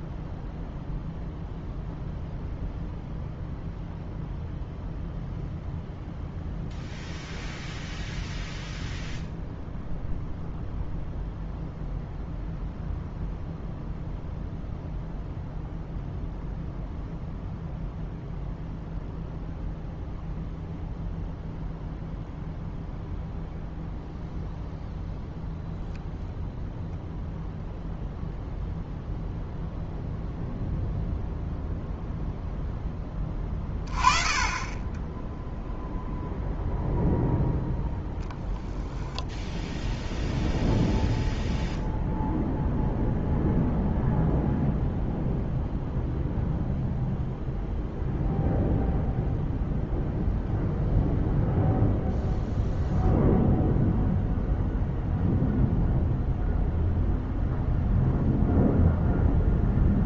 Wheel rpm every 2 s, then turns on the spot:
0, 0, 0, 0, 0, 0, 0, 0, 0, 0, 0, 0, 0, 0, 0, 0, 10, 20, 0, 0, 0, 0, 0, 0, 0, 0, 0, 0, 0, 0.
none